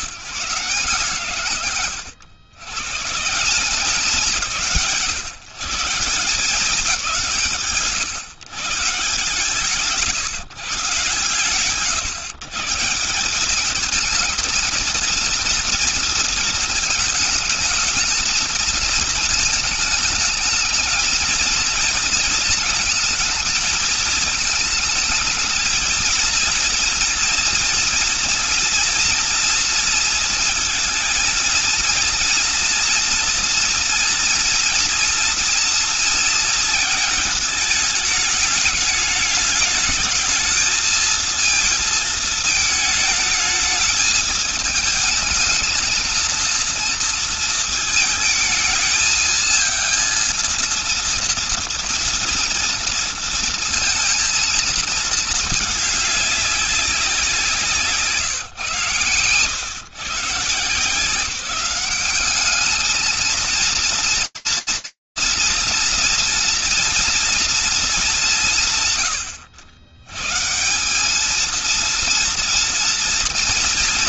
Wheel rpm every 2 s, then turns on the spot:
90, 100, 170, 170, 130, 150, 140, 220, 220, 230, 220, 230, 220, 230, 230, 230, 230, 230, 230, 210, 220, 220, 220, 230, 220, 220, 230, 230, 200, 130, 140, 200, 230, 230, 170, 140, 230.
none